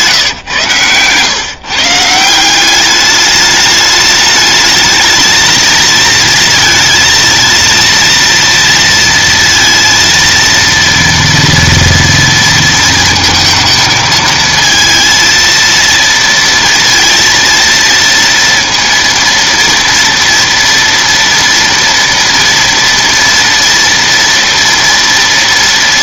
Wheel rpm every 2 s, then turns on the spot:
130, 170, 210, 230, 230, 230, 230, 230, 230, 230, 230, 230, 230.
0-2